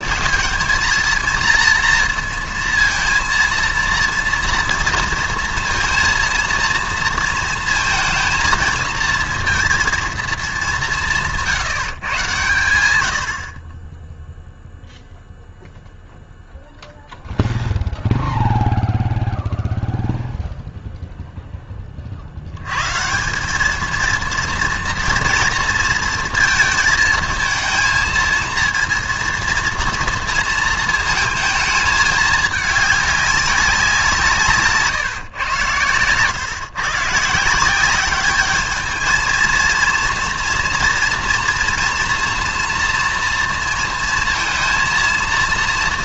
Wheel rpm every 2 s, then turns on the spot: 220, 230, 230, 230, 230, 200, 100, 0, 0, 0, 0, 100, 230, 220, 230, 230, 210, 140, 130, 210, 230, 230, 230.
none